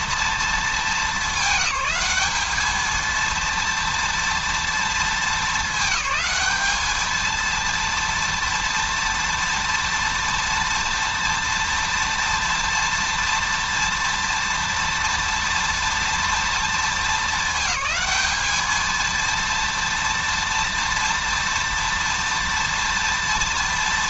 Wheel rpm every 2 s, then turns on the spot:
220, 210, 230, 220, 240, 230, 230, 230, 230, 220, 230, 230.
none